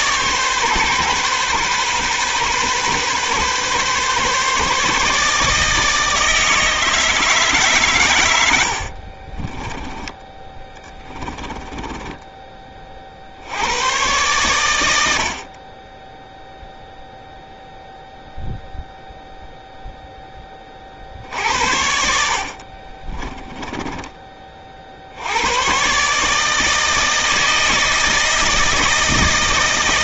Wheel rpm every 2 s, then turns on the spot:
140, 130, 150, 160, 60, 10, 20, 100, 0, 0, 30, 40, 60, 160, 160.
8-12 22-24